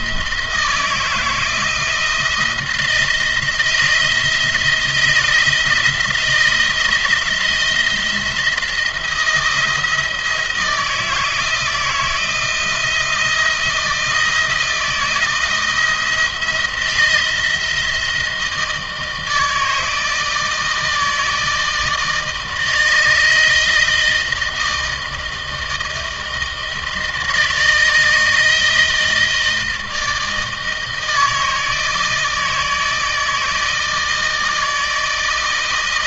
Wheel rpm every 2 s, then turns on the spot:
160, 160, 160, 170, 170, 160, 170, 160, 170, 160, 160, 160, 160, 160, 160, 160, 160, 160.
none